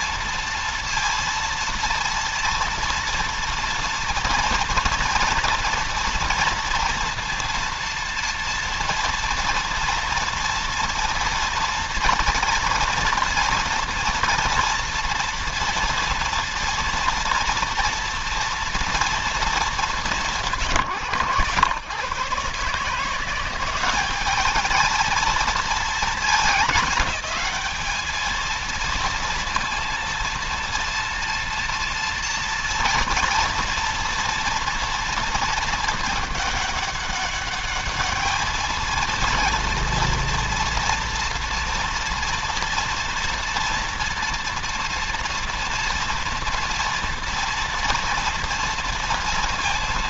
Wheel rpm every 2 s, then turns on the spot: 230, 230, 230, 230, 230, 230, 230, 230, 230, 230, 130, 160, 220, 210, 230, 230, 230, 230, 210, 220, 230, 240, 240, 230, 230.
none